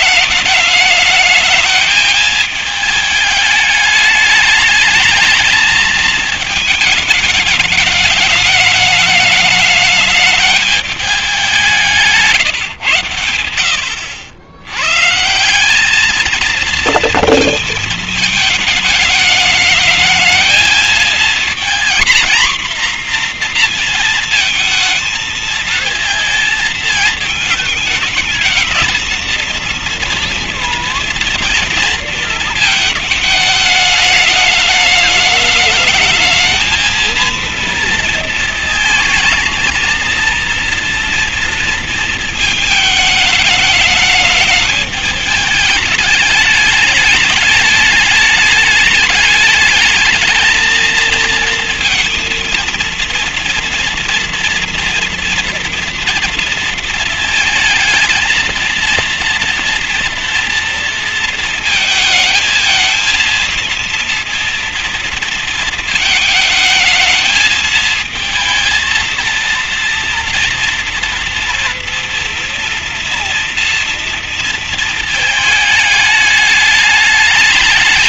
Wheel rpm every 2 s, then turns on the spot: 220, 210, 220, 210, 210, 190, 80, 180, 220, 210, 230, 240, 220, 220, 230, 230, 220, 220, 230, 230, 230, 210, 210, 220, 210, 230, 230, 230, 220, 240, 220, 230, 230, 220, 230, 230, 230, 220, 210.
none